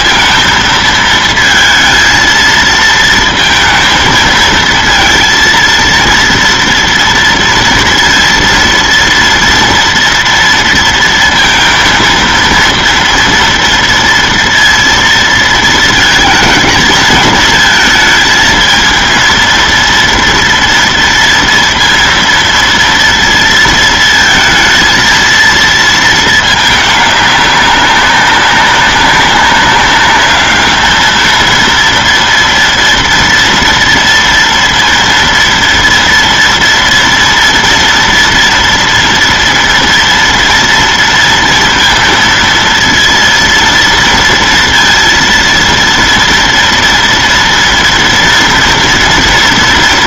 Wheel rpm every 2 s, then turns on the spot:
230, 230, 220, 230, 230, 230, 230, 230, 230, 220, 230, 230, 230, 210, 200, 210, 230, 230, 230, 230, 230, 230, 230, 230, 240.
none